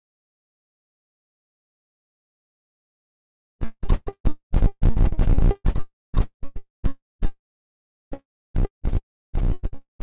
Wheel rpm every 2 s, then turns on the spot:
10, 30, 10, 10, 0.
2-8